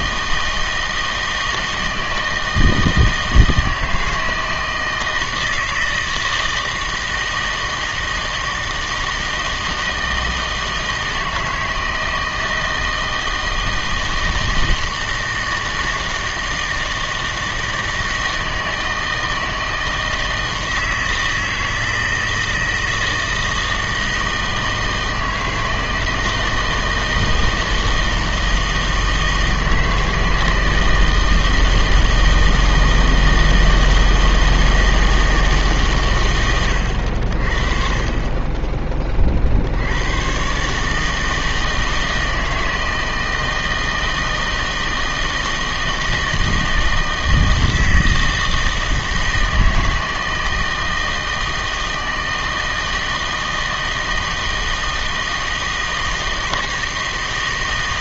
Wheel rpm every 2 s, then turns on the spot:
160, 160, 160, 160, 160, 160, 160, 160, 160, 160, 160, 160, 160, 160, 160, 160, 160, 160, 90, 20, 140, 160, 160, 160, 160, 160, 160, 160, 160.
none